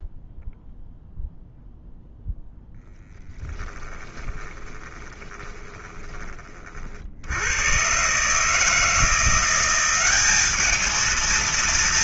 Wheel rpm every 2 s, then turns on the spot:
0, 0, 20, 20, 130, 200.
4-6